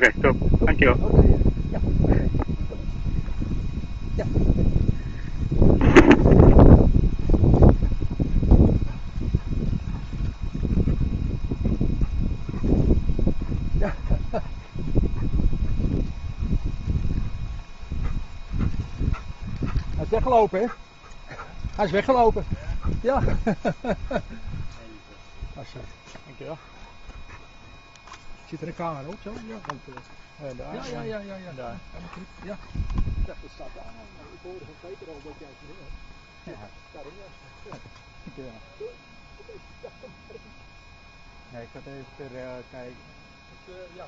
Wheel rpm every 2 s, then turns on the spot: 0, 0, 0, 0, 0, 0, 0, 0, 0, 0, 0, 0, 0, 0, 0, 0, 0, 0, 0, 0, 0, 0.
none